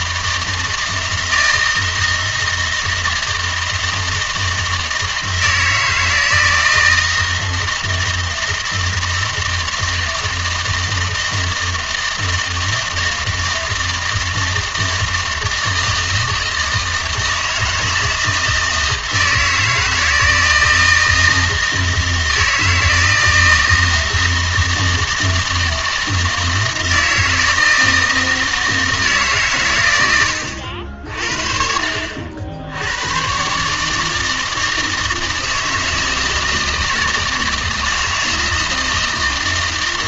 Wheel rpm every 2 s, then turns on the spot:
160, 160, 160, 160, 160, 160, 160, 160, 160, 160, 160, 160, 160, 160, 160, 70, 80, 160, 160, 160.
none